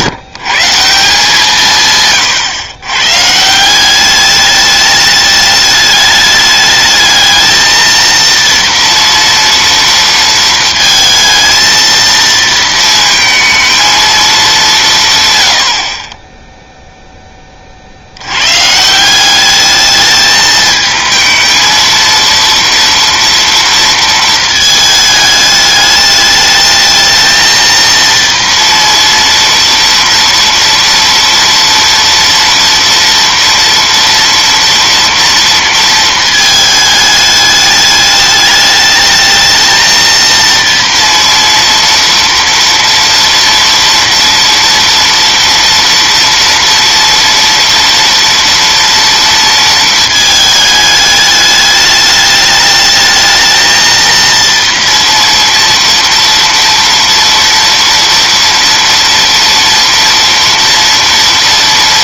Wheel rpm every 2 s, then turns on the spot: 170, 140, 210, 210, 230, 230, 230, 190, 0, 140, 220, 230, 220, 210, 230, 230, 230, 230, 220, 210, 230, 230, 230, 230, 230, 210, 210, 230, 230, 230, 230.
none